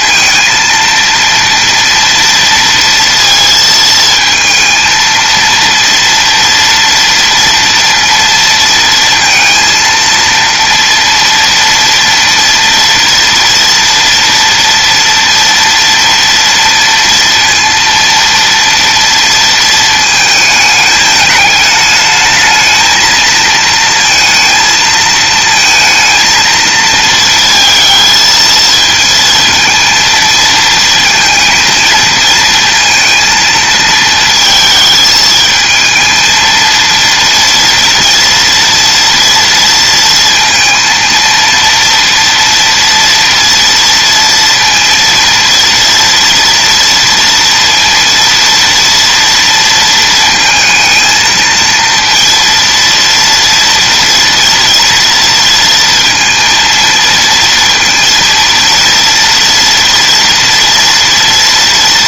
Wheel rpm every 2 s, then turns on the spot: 230, 230, 230, 230, 230, 230, 230, 230, 230, 230, 210, 220, 220, 230, 230, 230, 230, 220, 230, 230, 230, 230, 230, 230, 230, 220, 240, 230, 230, 230, 230.
none